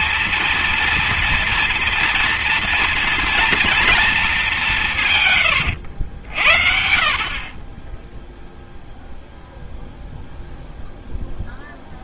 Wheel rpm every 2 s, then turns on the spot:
230, 230, 190, 60, 0, 0.
none